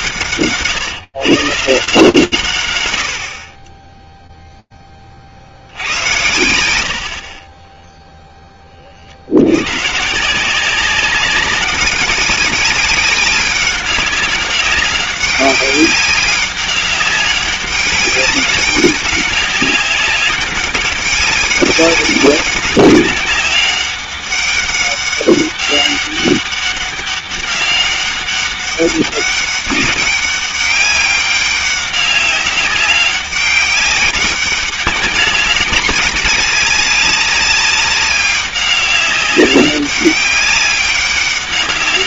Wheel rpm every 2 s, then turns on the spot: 150, 90, 20, 80, 50, 190, 190, 190, 200, 190, 200, 200, 200, 200, 190, 200, 200, 200, 200, 190, 200.
none